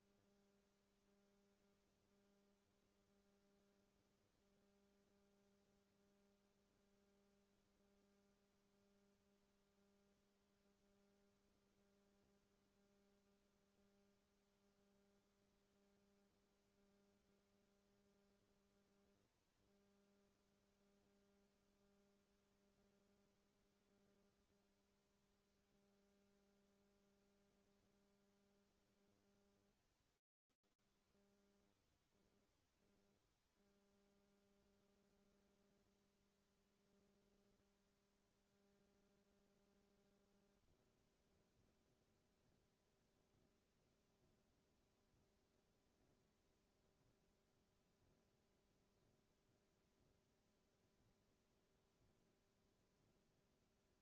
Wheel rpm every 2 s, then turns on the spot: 0, 0, 0, 0, 0, 0, 0, 0, 0, 0, 0, 0, 0, 0, 0, 0, 0, 0, 0, 0, 0, 0, 0, 0, 0, 0, 0.
none